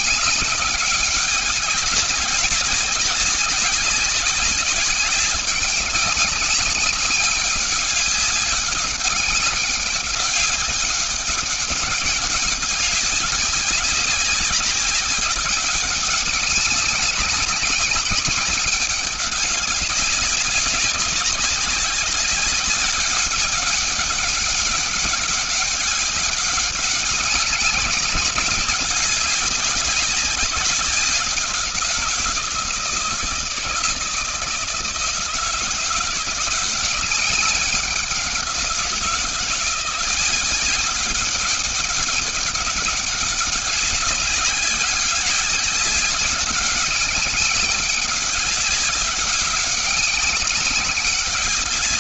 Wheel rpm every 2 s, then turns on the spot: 200, 190, 190, 190, 190, 200, 200, 200, 200, 200, 190, 200, 200, 200, 190, 200, 170, 160, 180, 180, 190, 200, 190, 200, 200, 200.
none